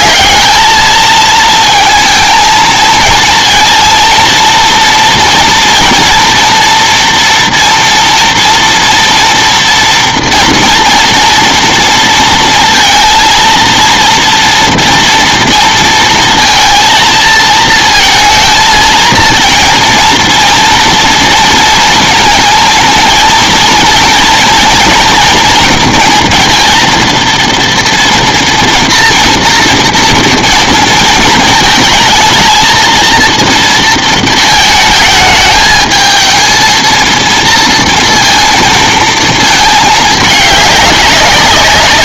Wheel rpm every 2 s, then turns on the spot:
220, 230, 230, 230, 230, 230, 230, 230, 230, 220, 230, 230, 230, 230, 240, 230, 220, 220, 230, 230, 200.
none